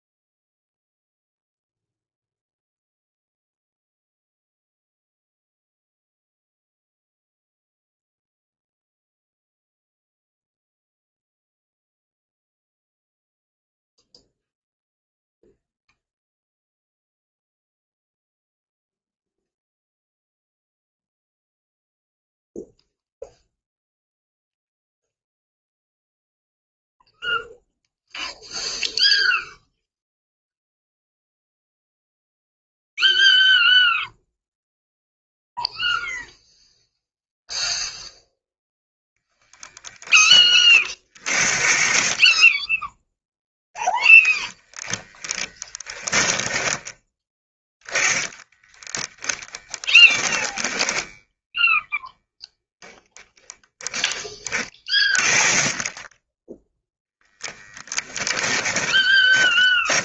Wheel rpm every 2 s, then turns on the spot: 0, 0, 0, 0, 0, 0, 0, 0, 0, 0, 0, 0, 0, 0, 0, 0, 0, 0, 0, 0, 40, 10, 20, 10, 10, 10, 0, 20, 10, 20.
44-52 58-60